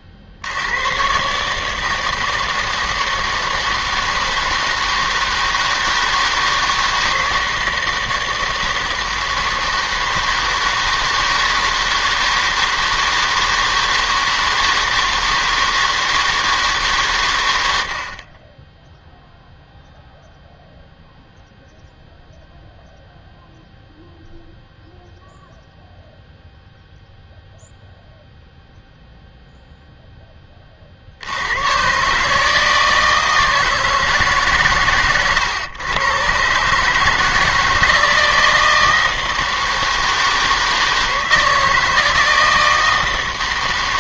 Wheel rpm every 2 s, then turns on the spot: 80, 160, 160, 160, 160, 160, 160, 160, 150, 20, 0, 0, 0, 0, 0, 20, 160, 130, 140, 160, 160, 160.
none